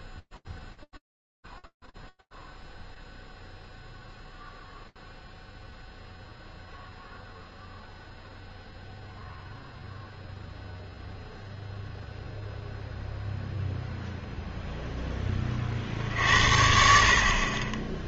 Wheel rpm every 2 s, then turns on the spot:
0, 0, 0, 0, 0, 0, 0, 10, 50.
none